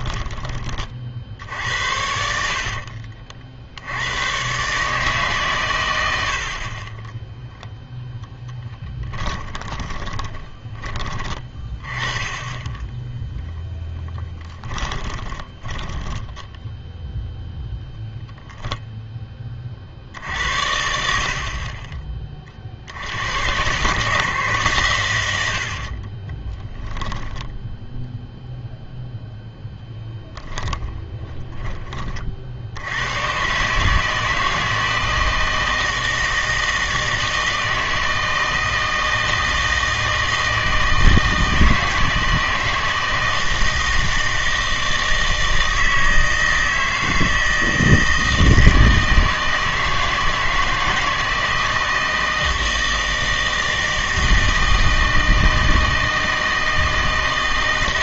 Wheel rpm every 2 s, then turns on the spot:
20, 50, 140, 30, 20, 30, 20, 10, 0, 0, 70, 50, 130, 10, 0, 20, 80, 160, 160, 160, 160, 160, 160, 160, 160, 160, 160, 160, 160.
2-4 8-10 14-16 26-28 30-32